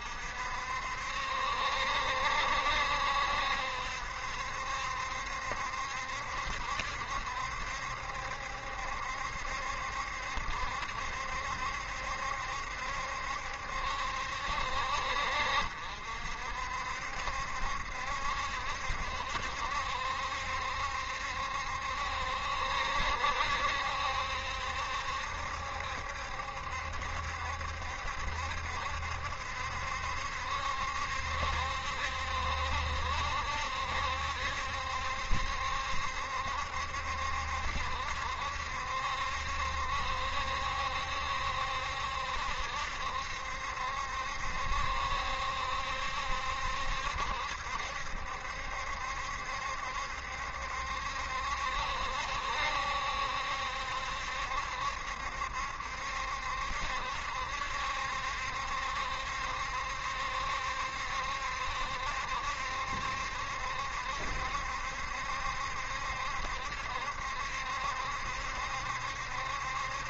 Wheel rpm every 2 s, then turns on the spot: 60, 70, 70, 70, 70, 70, 70, 60, 60, 70, 70, 70, 70, 70, 70, 70, 70, 70, 70, 70, 70, 70, 70, 70, 70, 70, 70, 70, 70, 70, 70, 70, 70, 70, 70.
none